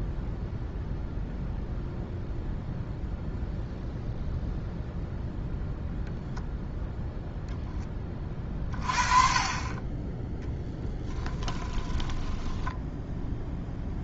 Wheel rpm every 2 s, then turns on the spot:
0, 0, 0, 0, 30, 10, 10.
12-14